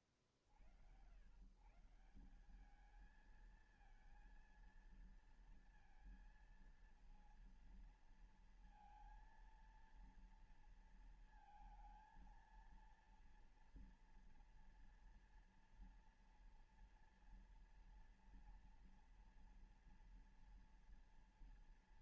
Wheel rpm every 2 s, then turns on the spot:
90, 210, 230, 230, 230, 230, 230, 240, 230, 230, 240.
none